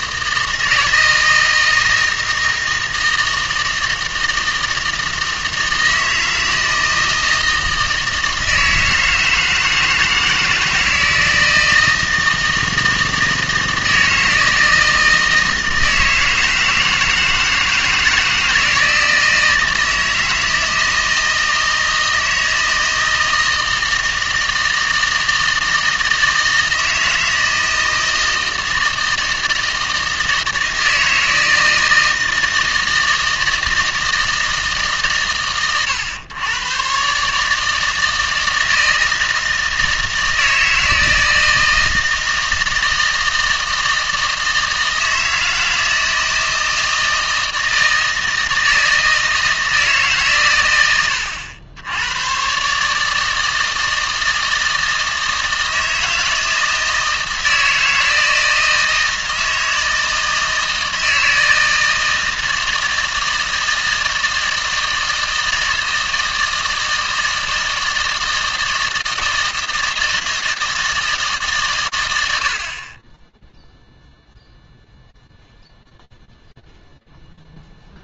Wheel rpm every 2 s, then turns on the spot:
160, 160, 160, 160, 160, 160, 160, 160, 160, 160, 160, 160, 160, 160, 160, 160, 170, 150, 120, 160, 160, 160, 160, 160, 160, 110, 140, 160, 160, 160, 160, 160, 160, 160, 160, 160, 50, 0, 0.
none